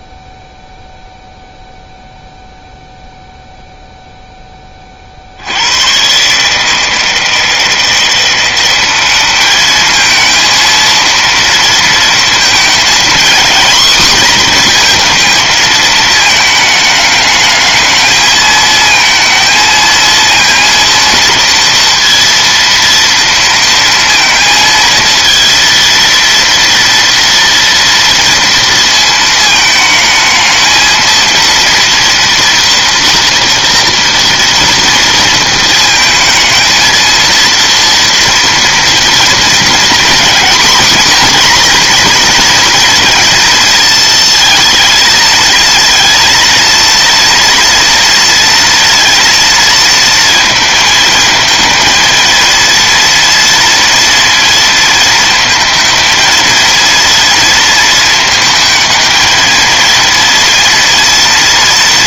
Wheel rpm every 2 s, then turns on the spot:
0, 0, 80, 160, 210, 230, 240, 220, 210, 230, 230, 230, 230, 230, 220, 230, 230, 220, 230, 230, 240, 230, 230, 230, 230, 220, 230, 220, 230, 220, 230.
none